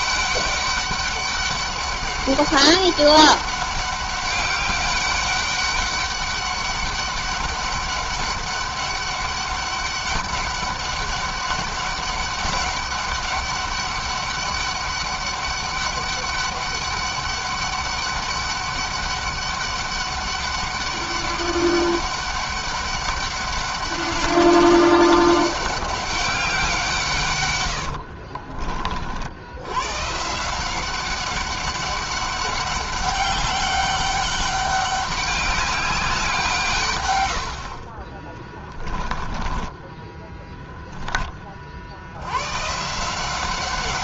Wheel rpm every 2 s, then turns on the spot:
200, 200, 200, 200, 200, 200, 200, 200, 200, 200, 200, 200, 200, 190, 70, 140, 200, 200, 170, 20, 10, 100.
28-30 38-40